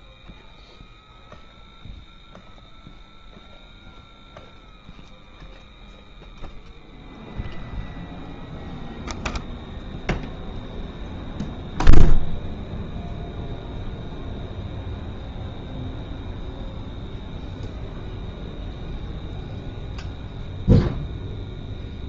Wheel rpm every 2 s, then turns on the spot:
0, 0, 0, 0, 0, 0, 0, 0, 0, 0, 0.
none